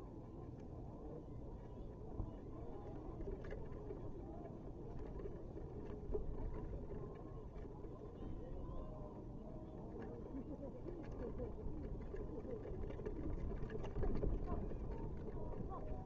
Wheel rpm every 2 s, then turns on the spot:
0, 0, 0, 0, 0, 0, 0, 0.
none